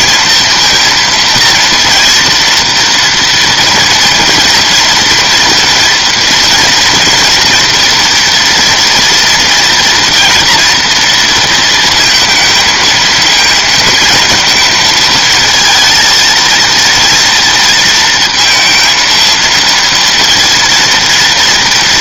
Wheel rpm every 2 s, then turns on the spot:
230, 230, 230, 240, 230, 230, 230, 220, 230, 230, 230.
none